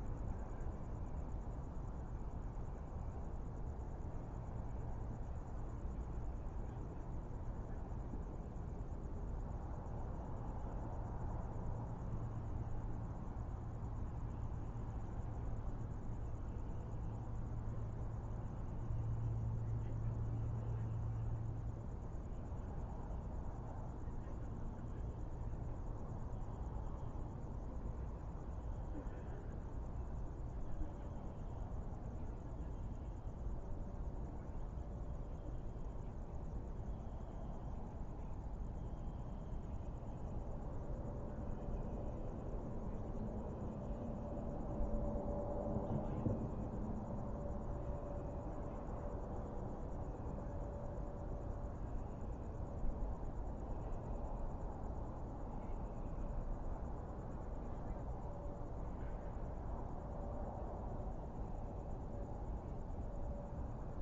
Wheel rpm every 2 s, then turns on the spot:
0, 0, 0, 0, 0, 0, 0, 0, 0, 0, 0, 0, 0, 0, 0, 0, 0, 0, 0, 0, 0, 0, 0, 0, 0, 0, 0, 0, 0, 0, 0, 0.
none